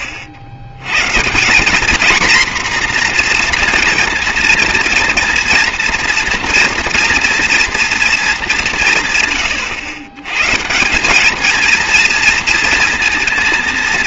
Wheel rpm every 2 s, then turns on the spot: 90, 240, 230, 230, 170, 150, 230.
none